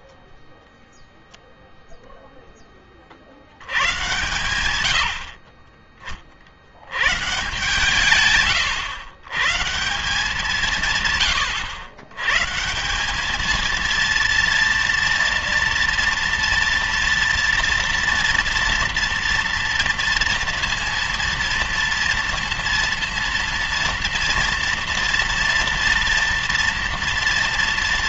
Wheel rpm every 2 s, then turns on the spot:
0, 20, 100, 90, 110, 150, 160, 230, 230, 230, 230, 230, 230, 230.
none